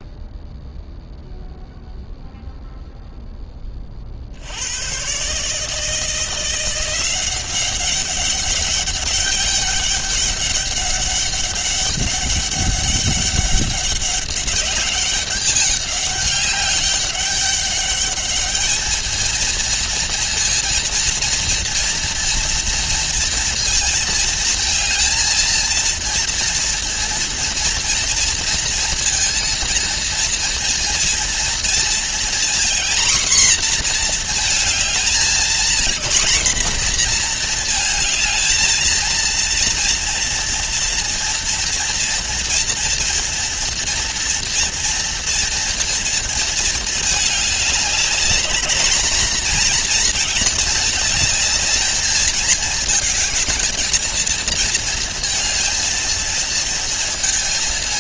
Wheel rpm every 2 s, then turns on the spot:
0, 0, 90, 170, 200, 200, 200, 200, 200, 220, 230, 230, 220, 230, 230, 230, 240, 220, 240, 220, 230, 230, 230, 220, 220, 220, 220, 230, 220.
none